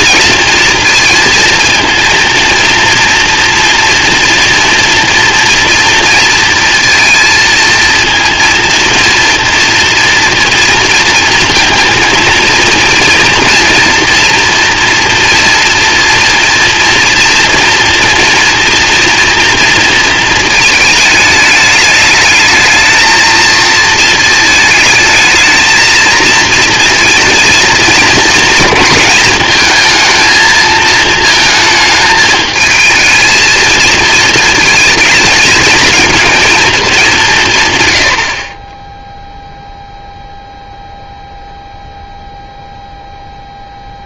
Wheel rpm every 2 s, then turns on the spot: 230, 230, 240, 230, 230, 230, 230, 240, 230, 240, 220, 220, 220, 230, 230, 220, 220, 230, 220, 30, 0, 0.
none